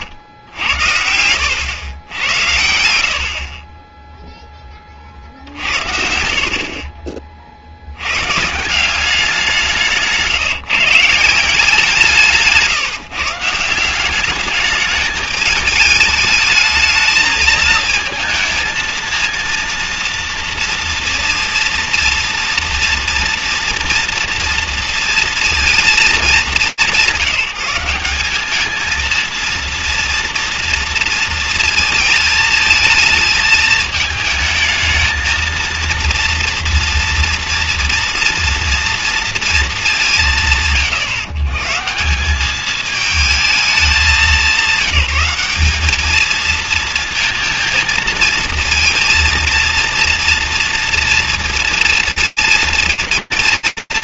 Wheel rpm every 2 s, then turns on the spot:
90, 90, 0, 70, 150, 150, 160, 210, 210, 220, 230, 230, 230, 200, 200, 230, 220, 220, 230, 240, 120, 200, 190, 220, 230, 230, 230.
12-14